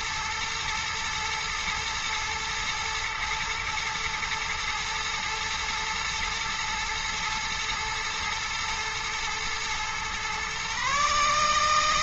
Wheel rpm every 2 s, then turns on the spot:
120, 120, 110, 110, 120, 140.
none